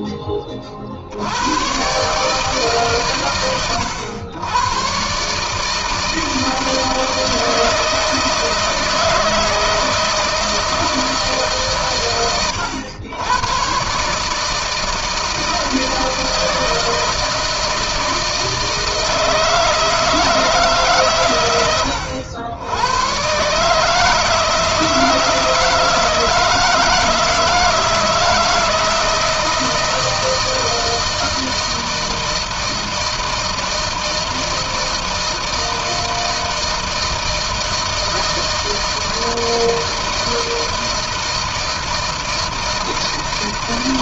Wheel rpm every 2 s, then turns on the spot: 50, 110, 130, 160, 160, 150, 110, 160, 160, 170, 120, 110, 160, 160, 160, 170, 160, 160, 160, 160, 160, 160.
none